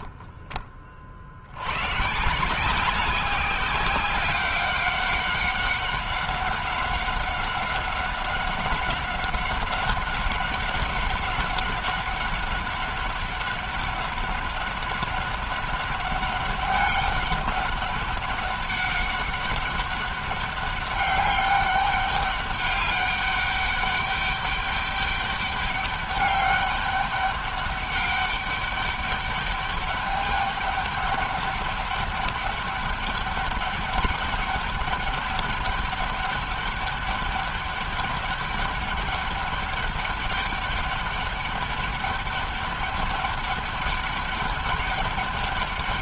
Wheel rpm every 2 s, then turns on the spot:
50, 190, 190, 190, 190, 200, 200, 200, 200, 200, 200, 200, 200, 200, 200, 200, 200, 200, 200, 200, 200, 200, 200.
none